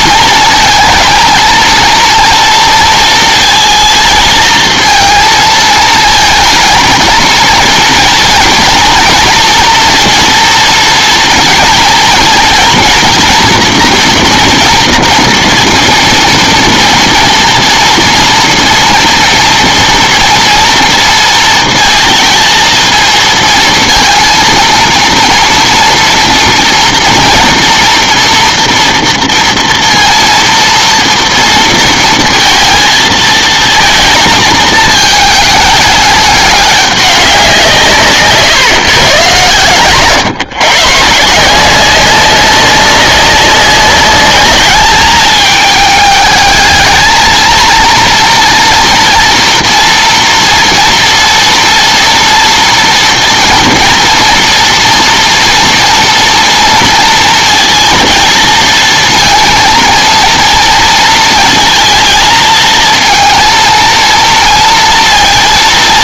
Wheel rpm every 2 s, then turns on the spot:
230, 230, 230, 220, 240, 230, 240, 240, 230, 230, 230, 230, 230, 230, 240, 230, 230, 220, 210, 140, 130, 190, 210, 220, 230, 230, 230, 230, 230, 230, 230, 220, 230.
none